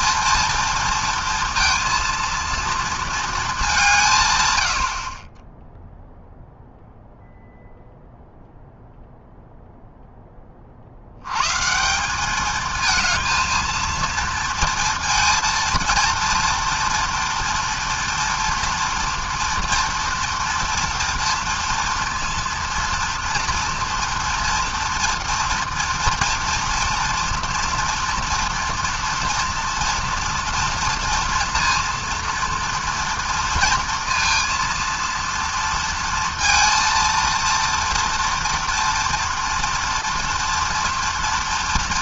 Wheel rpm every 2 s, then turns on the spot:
230, 230, 100, 0, 0, 40, 220, 230, 230, 230, 240, 230, 230, 240, 230, 230, 230, 230, 230, 230, 230.
none